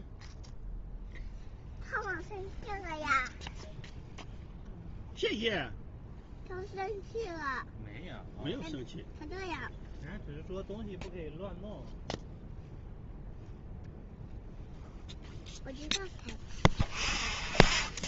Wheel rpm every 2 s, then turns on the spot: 0, 0, 0, 0, 0, 0, 0, 0, 0.
none